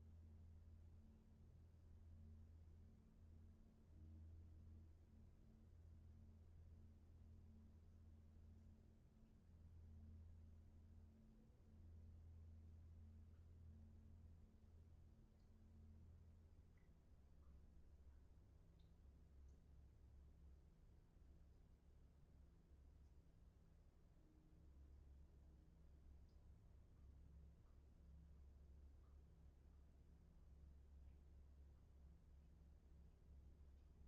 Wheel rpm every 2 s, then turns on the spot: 0, 0, 0, 0, 0, 0, 0, 0, 0, 0, 0, 0, 0, 0, 0, 0, 0.
none